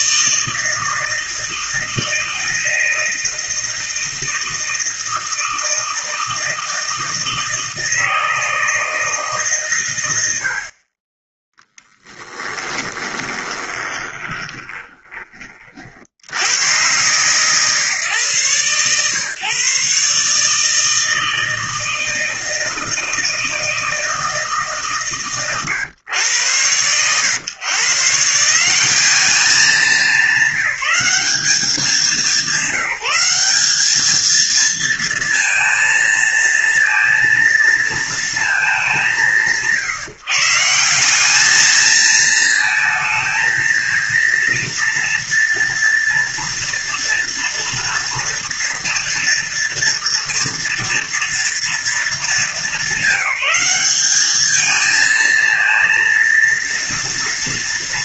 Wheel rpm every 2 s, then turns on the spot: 160, 160, 160, 160, 160, 40, 20, 20, 110, 130, 160, 160, 140, 100, 190, 200, 190, 230, 230, 190, 170, 220, 230, 230, 230, 230, 200, 220, 240.
12-16